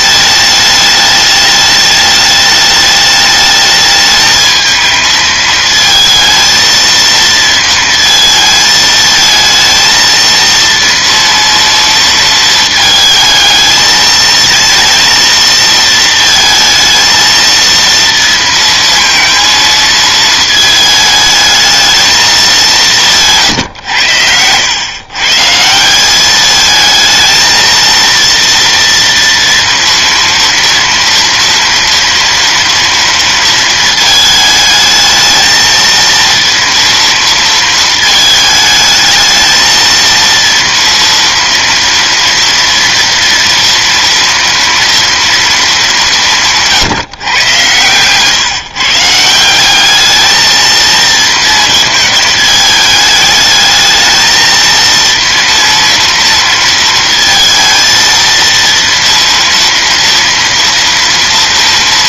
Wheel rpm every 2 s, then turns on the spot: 210, 210, 220, 230, 220, 230, 220, 230, 230, 230, 220, 200, 110, 220, 230, 230, 230, 220, 230, 220, 230, 230, 230, 160, 140, 220, 210, 230, 230, 230, 230.
none